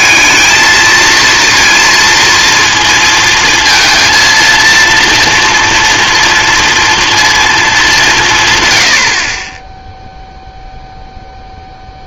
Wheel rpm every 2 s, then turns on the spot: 220, 230, 230, 230, 90, 0.
none